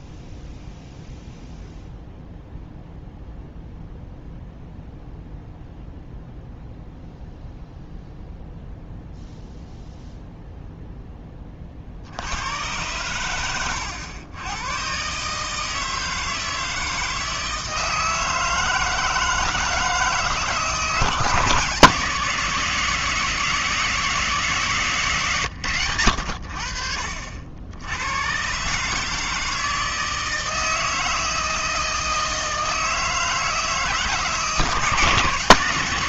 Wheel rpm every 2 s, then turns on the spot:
0, 0, 0, 0, 0, 0, 100, 120, 160, 160, 160, 180, 160, 60, 150, 160, 160, 160.
none